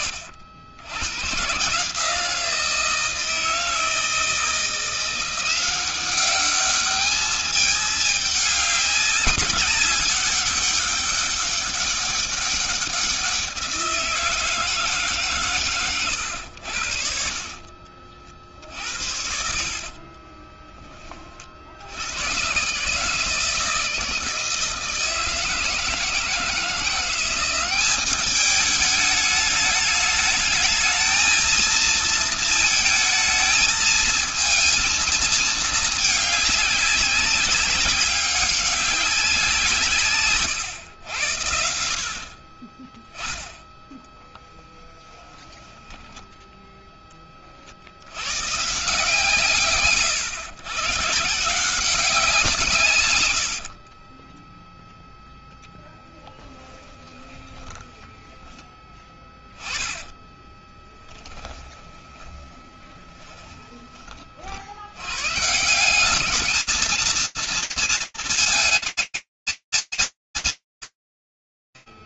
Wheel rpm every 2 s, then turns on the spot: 120, 160, 170, 210, 200, 200, 180, 150, 70, 70, 40, 150, 160, 180, 210, 220, 220, 220, 200, 180, 80, 10, 10, 20, 140, 140, 110, 0, 20, 10, 10, 20, 120, 230, 220, 70.
16-20 56-58 60-64